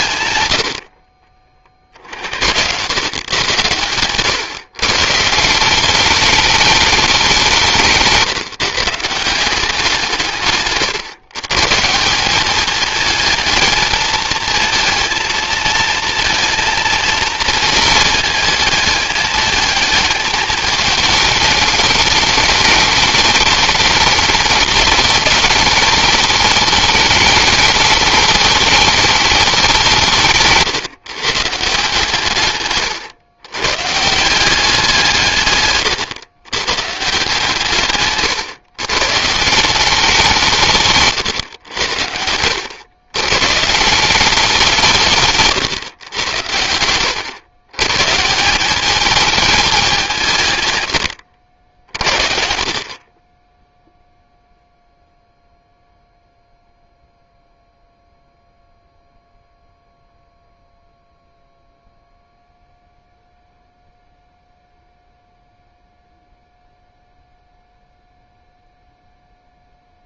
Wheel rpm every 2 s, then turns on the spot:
90, 100, 140, 210, 150, 130, 210, 220, 230, 220, 210, 210, 210, 220, 220, 150, 130, 180, 130, 130, 140, 100, 180, 90, 200, 120, 40, 0, 0, 0, 0, 0, 0, 0, 0.
none